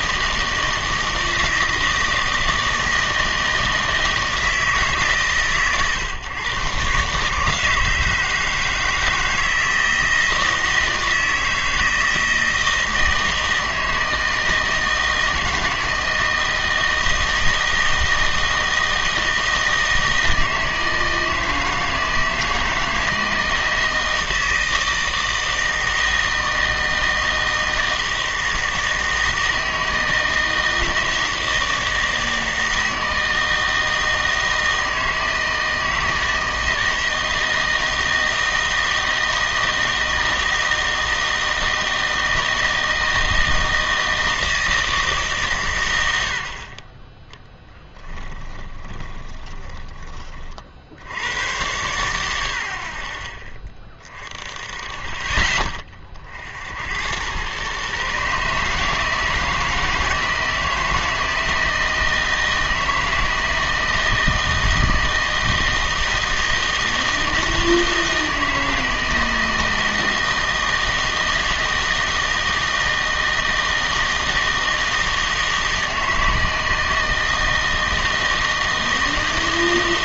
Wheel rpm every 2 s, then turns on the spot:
160, 160, 160, 130, 160, 160, 160, 160, 160, 160, 160, 160, 160, 160, 160, 160, 160, 160, 160, 160, 160, 160, 160, 50, 20, 40, 80, 30, 70, 150, 160, 160, 160, 160, 160, 160, 160, 160, 160, 160.
48-50